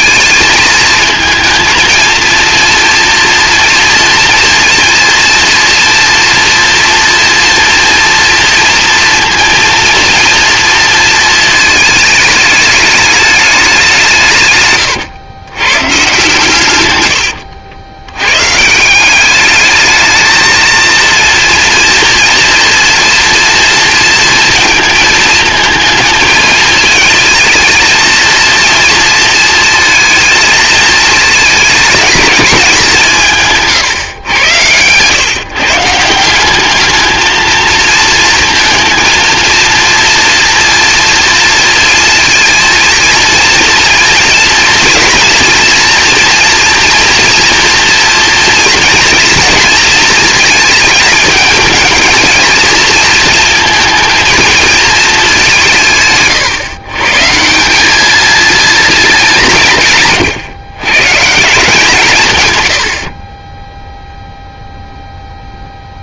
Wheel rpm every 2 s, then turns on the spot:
220, 230, 230, 230, 240, 230, 210, 140, 120, 160, 230, 230, 230, 220, 230, 230, 190, 120, 210, 230, 230, 230, 240, 230, 230, 220, 230, 220, 130, 220, 130, 80, 0.
14-16